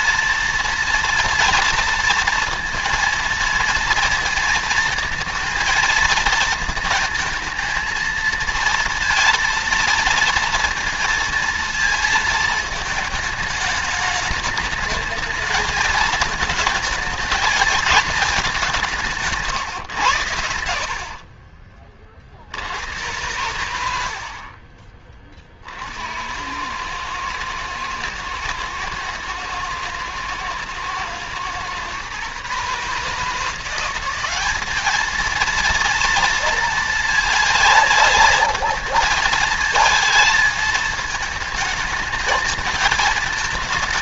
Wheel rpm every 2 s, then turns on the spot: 230, 230, 230, 220, 230, 230, 220, 220, 220, 210, 90, 70, 50, 90, 110, 110, 140, 200, 230, 220, 220, 220.
20-22